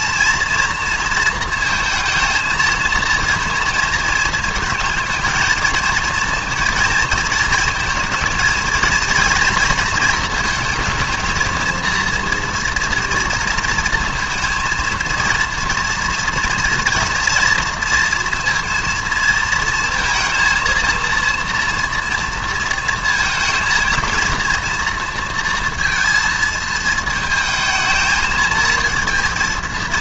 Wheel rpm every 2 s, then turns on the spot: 230, 230, 230, 230, 230, 230, 240, 230, 230, 230, 230, 230, 230, 230, 220.
none